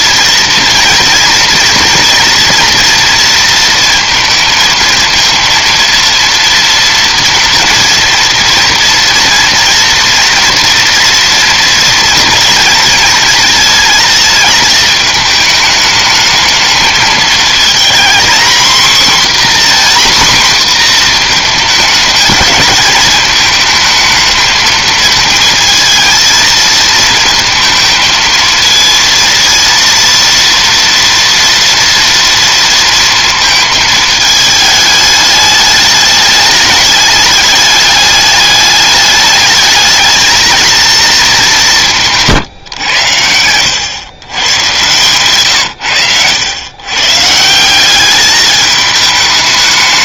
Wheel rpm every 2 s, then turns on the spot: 240, 230, 220, 230, 230, 240, 220, 220, 220, 250, 250, 220, 220, 230, 230, 230, 230, 210, 210, 210, 220, 120, 130, 120, 210.
none